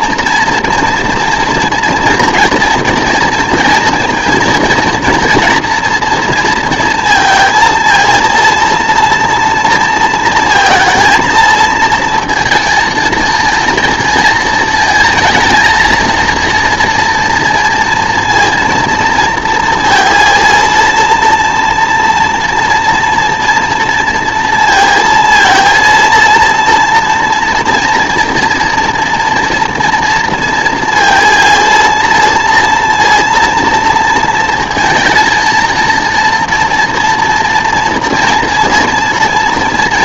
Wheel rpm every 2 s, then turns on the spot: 230, 230, 230, 230, 230, 230, 230, 220, 230, 230, 230, 230, 230, 230, 230, 230, 230, 230, 240, 230.
none